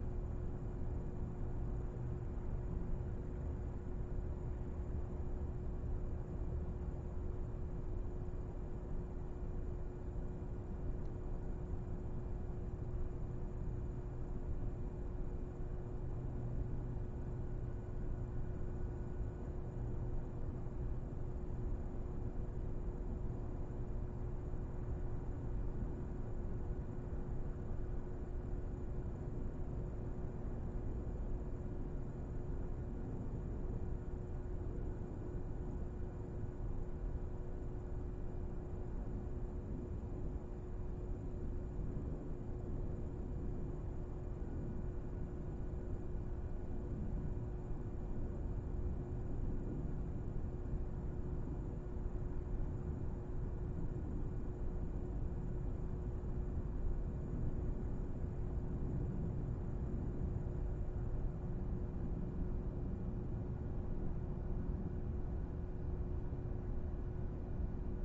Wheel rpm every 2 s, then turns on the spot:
0, 0, 0, 0, 0, 0, 0, 0, 0, 0, 0, 0, 0, 0, 0, 0, 0, 0, 0, 0, 0, 0, 0, 0, 0, 0, 0, 0, 0, 0, 0, 0, 0, 0.
none